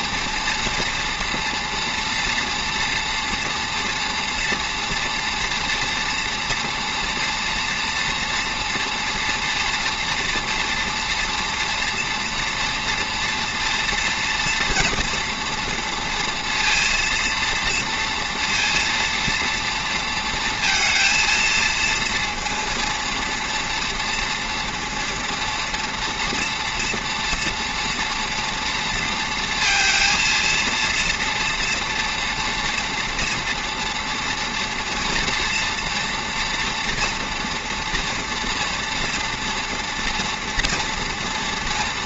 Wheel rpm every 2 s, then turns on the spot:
230, 230, 230, 230, 230, 230, 240, 240, 230, 230, 230, 230, 230, 230, 230, 230, 230, 230, 230, 230, 230.
none